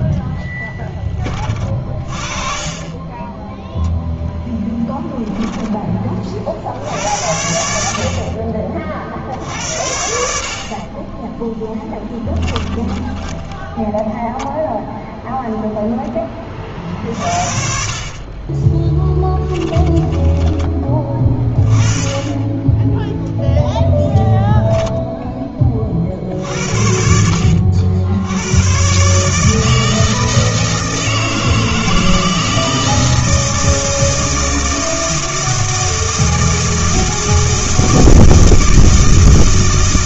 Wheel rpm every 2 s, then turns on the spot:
10, 30, 10, 60, 40, 50, 20, 0, 40, 20, 30, 10, 0, 60, 110, 160, 160, 160, 160, 160.
4-6 12-14 18-20 22-24